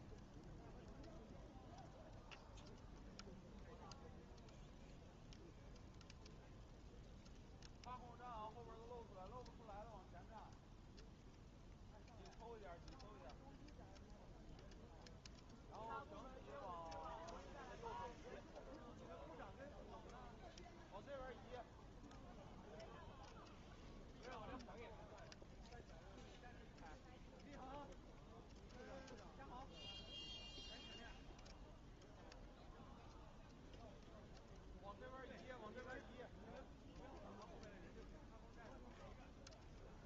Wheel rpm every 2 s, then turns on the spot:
0, 0, 0, 0, 0, 0, 0, 0, 0, 0, 0, 0, 0, 0, 0, 0, 0, 0, 0, 0.
none